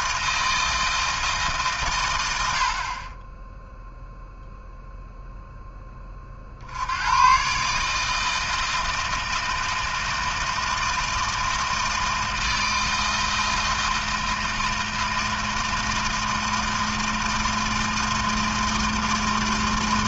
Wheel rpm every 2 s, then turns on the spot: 160, 80, 0, 60, 160, 160, 160, 160, 160, 160.
none